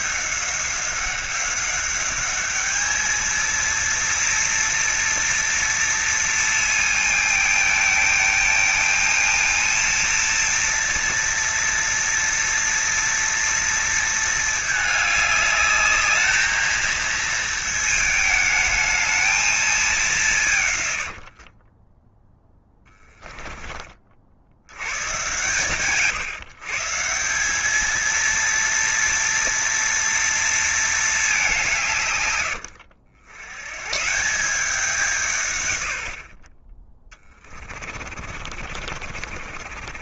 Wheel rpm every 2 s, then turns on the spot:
190, 220, 230, 220, 220, 230, 230, 220, 220, 220, 110, 10, 110, 150, 230, 220, 90, 180, 20, 50.
22-24 38-40